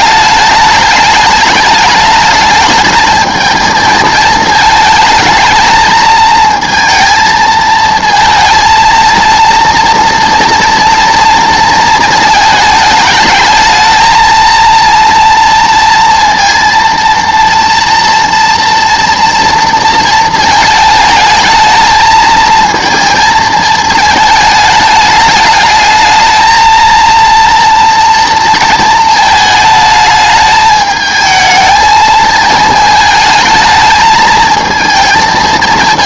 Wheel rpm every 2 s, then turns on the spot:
210, 210, 220, 230, 230, 230, 220, 230, 230, 240, 220, 220, 210, 220, 230, 210, 220, 230.
none